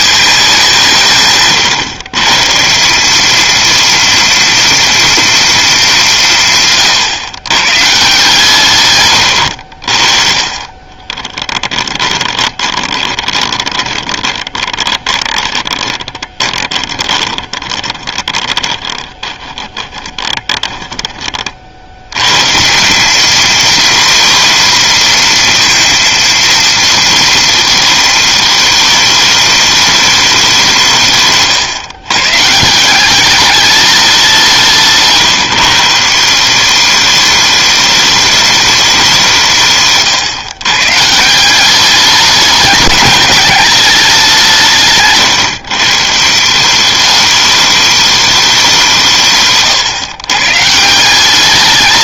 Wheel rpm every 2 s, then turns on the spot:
180, 180, 230, 140, 130, 30, 20, 20, 20, 20, 20, 170, 240, 230, 210, 170, 170, 160, 190, 200, 140, 200, 150, 190, 180, 140.
12-22